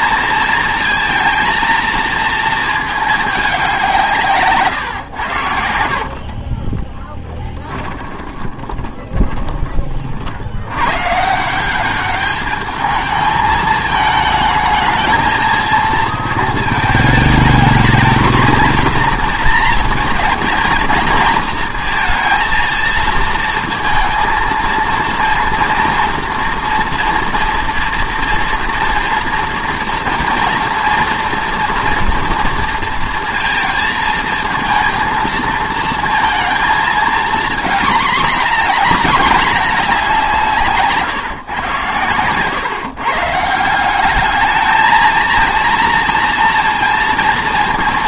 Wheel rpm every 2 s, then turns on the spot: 230, 210, 130, 30, 20, 90, 210, 220, 220, 230, 220, 230, 230, 230, 230, 230, 230, 230, 230, 220, 160, 130, 220, 230.
6-10